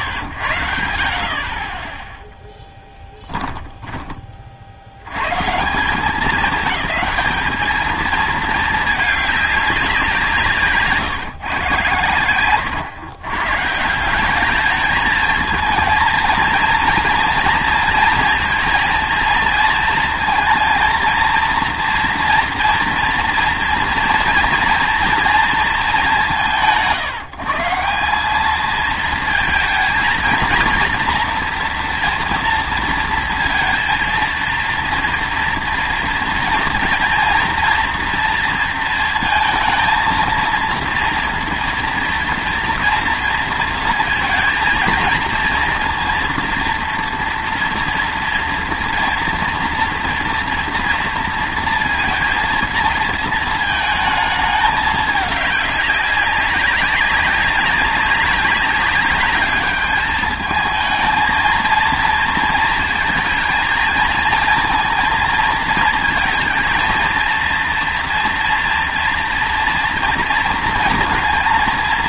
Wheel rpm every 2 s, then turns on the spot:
70, 10, 50, 220, 220, 160, 130, 210, 230, 230, 230, 230, 230, 140, 220, 230, 230, 230, 230, 230, 230, 230, 230, 230, 230, 230, 230, 210, 200, 200, 220, 230, 220, 230, 230, 230.
2-4